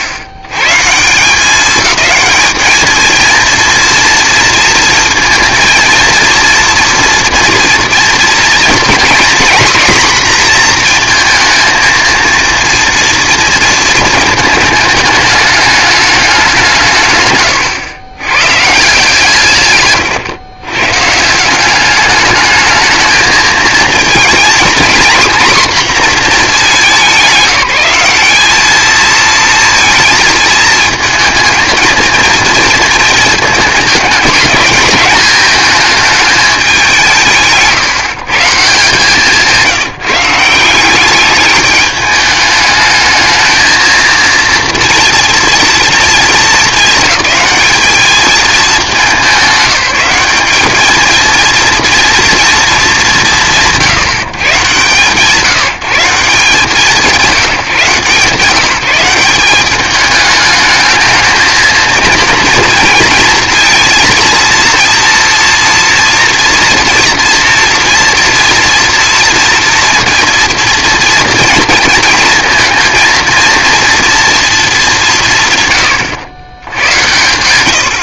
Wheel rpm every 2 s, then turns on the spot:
120, 220, 230, 230, 230, 240, 230, 220, 180, 140, 130, 210, 240, 200, 210, 220, 230, 210, 200, 160, 180, 210, 230, 210, 200, 210, 180, 120, 160, 170, 210, 230, 230, 230, 230, 230, 230, 230, 100.
none